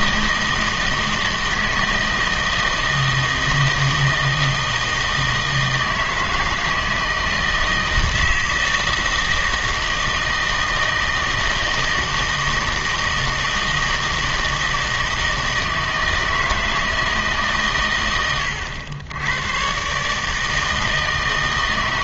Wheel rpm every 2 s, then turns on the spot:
160, 160, 160, 160, 160, 160, 160, 160, 160, 90, 160.
none